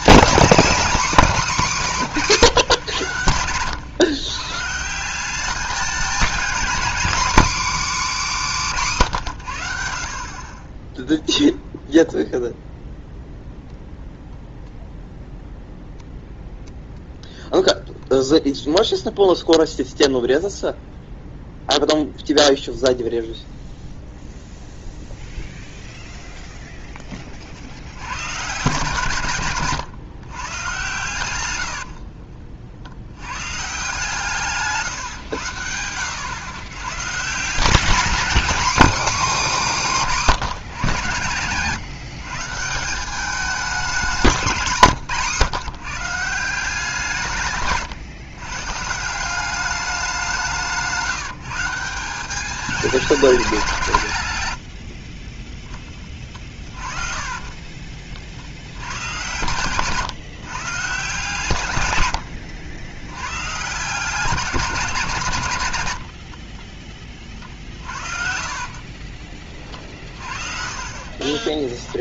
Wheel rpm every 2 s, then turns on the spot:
240, 140, 150, 240, 230, 20, 0, 0, 0, 0, 0, 0, 0, 0, 140, 130, 50, 150, 120, 270, 170, 160, 180, 170, 140, 180, 210, 90, 30, 80, 140, 90, 190, 50, 40, 40.
44-46 54-58 66-72